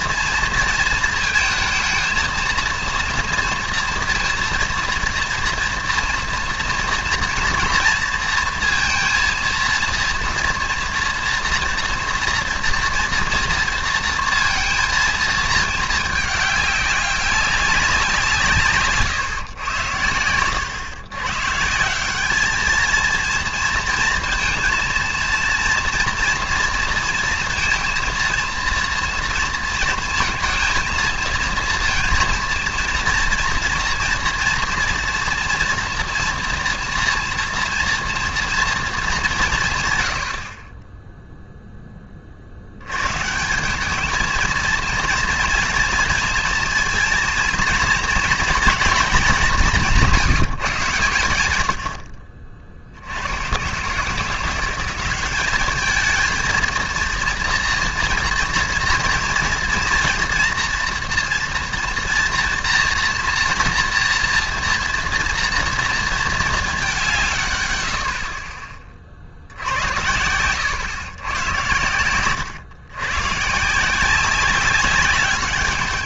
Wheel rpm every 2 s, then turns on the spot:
230, 220, 230, 230, 230, 230, 240, 230, 200, 150, 120, 220, 230, 230, 230, 220, 230, 230, 230, 230, 30, 80, 230, 230, 230, 140, 60, 180, 230, 240, 240, 230, 230, 200, 40, 100, 120, 190.
none